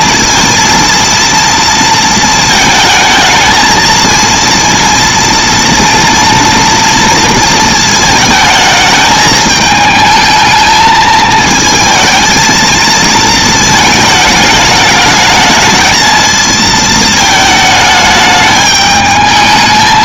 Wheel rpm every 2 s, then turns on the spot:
230, 220, 230, 230, 220, 220, 230, 210, 220, 210.
none